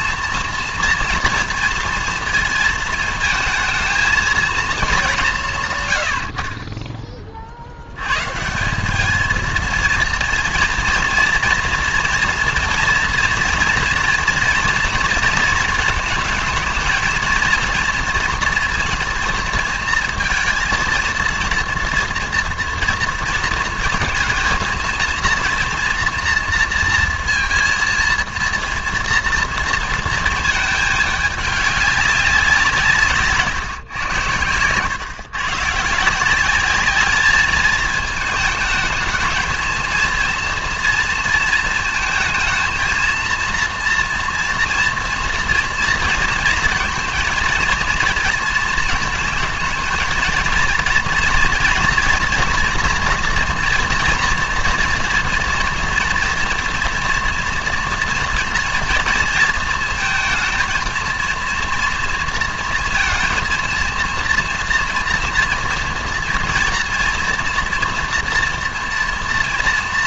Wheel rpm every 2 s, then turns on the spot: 230, 220, 230, 30, 180, 230, 230, 230, 220, 230, 230, 230, 230, 230, 230, 220, 160, 110, 200, 210, 240, 230, 230, 230, 230, 230, 230, 230, 230, 230, 230, 230, 230, 230, 240.
none